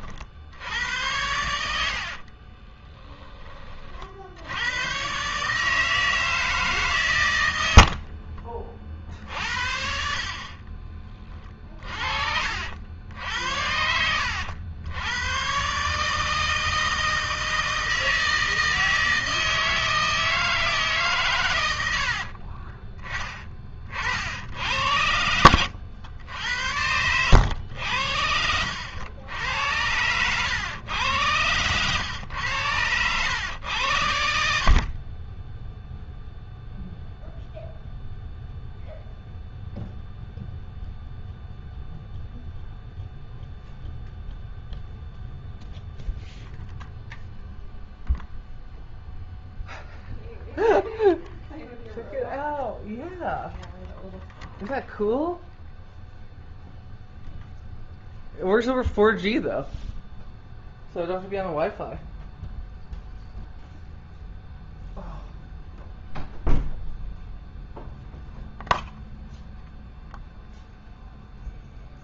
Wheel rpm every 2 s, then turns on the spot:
90, 20, 120, 130, 40, 30, 70, 100, 160, 160, 140, 20, 80, 90, 80, 100, 100, 40, 0, 0, 0, 0, 0, 0, 0, 0, 0, 0, 0, 0, 0, 0, 0, 0, 0, 0.
0-4 10-12 24-26